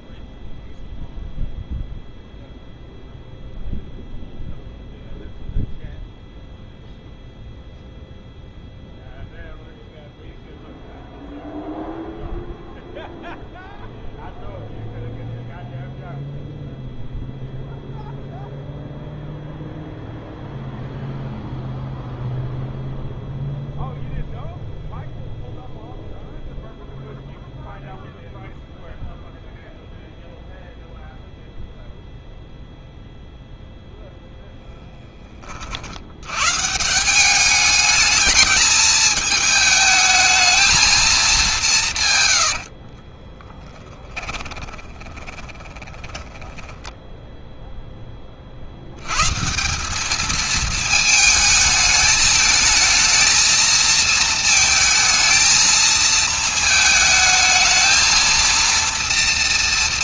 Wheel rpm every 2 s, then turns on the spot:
0, 0, 0, 0, 0, 0, 0, 0, 0, 0, 0, 0, 0, 0, 0, 0, 0, 20, 150, 210, 220, 70, 20, 10, 70, 220, 220, 220, 220, 230.
42-48